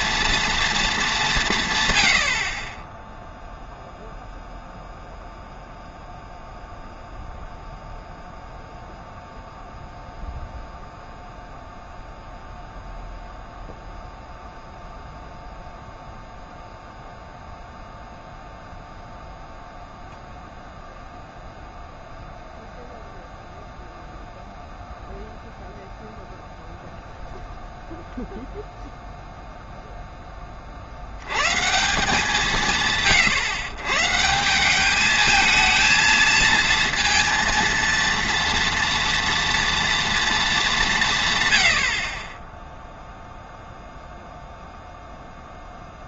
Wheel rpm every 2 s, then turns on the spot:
230, 30, 0, 0, 0, 0, 0, 0, 0, 0, 0, 0, 0, 0, 0, 40, 160, 190, 230, 230, 200, 10, 0.
none